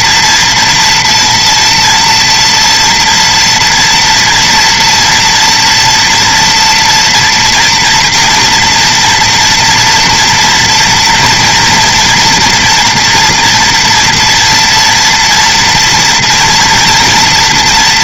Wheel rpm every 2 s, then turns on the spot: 230, 230, 230, 240, 230, 230, 230, 230, 230.
none